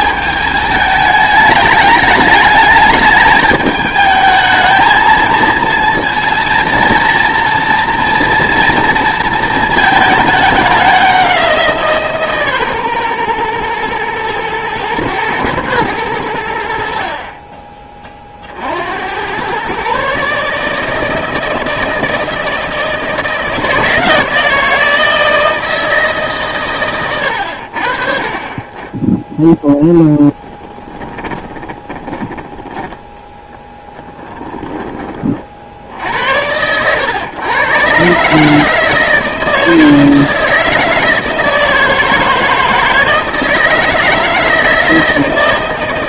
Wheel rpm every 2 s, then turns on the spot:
210, 210, 220, 230, 230, 200, 130, 110, 60, 60, 150, 160, 160, 130, 20, 10, 10, 30, 90, 150, 160, 160, 160.
30-32